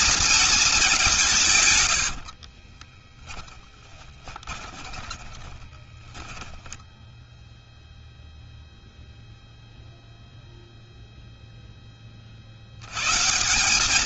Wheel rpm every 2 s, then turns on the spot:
210, 50, 20, 10, 0, 0, 130.
2-6